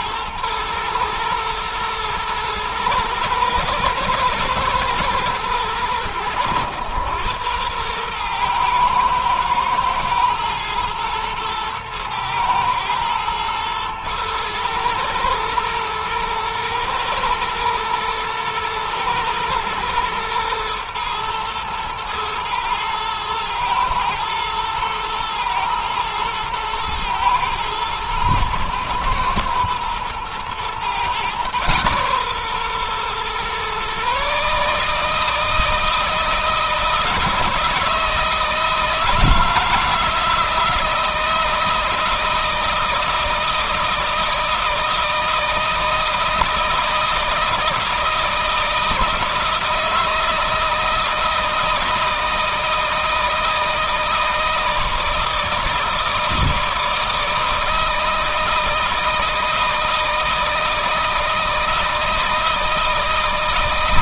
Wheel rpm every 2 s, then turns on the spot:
110, 110, 110, 110, 110, 120, 110, 120, 110, 110, 120, 110, 110, 110, 110, 120, 130, 160, 160, 160, 160, 160, 160, 160, 160, 160, 160, 160, 160, 160, 160, 160.
none